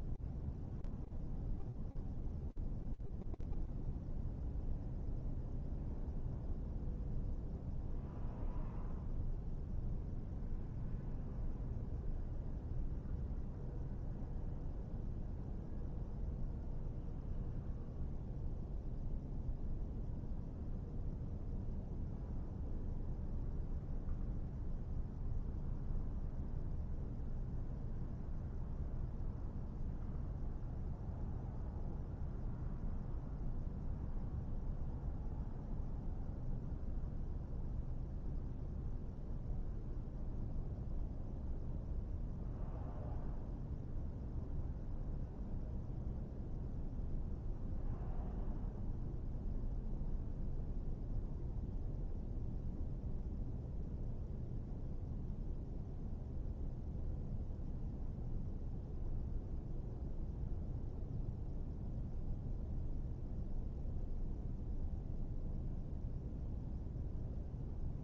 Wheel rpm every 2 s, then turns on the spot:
0, 0, 0, 0, 0, 0, 0, 0, 0, 0, 0, 0, 0, 0, 0, 0, 0, 0, 0, 0, 0, 0, 0, 0, 0, 0, 0, 0, 0, 0, 0, 0, 0, 0.
none